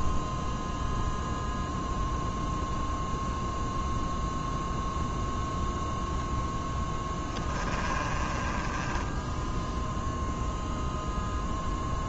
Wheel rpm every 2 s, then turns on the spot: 0, 0, 0, 10, 10, 0.
6-10